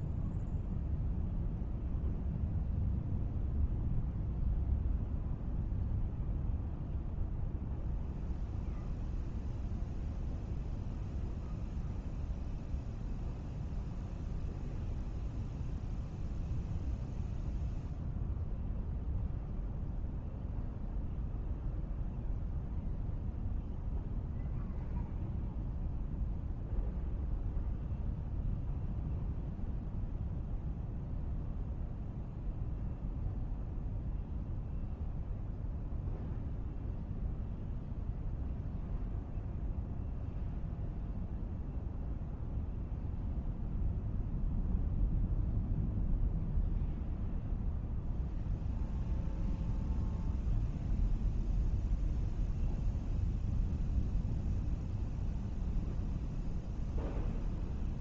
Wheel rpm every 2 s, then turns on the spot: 0, 0, 0, 0, 0, 0, 0, 0, 0, 0, 0, 0, 0, 0, 0, 0, 0, 0, 0, 0, 0, 0, 0, 0, 0, 0, 0, 0, 0.
none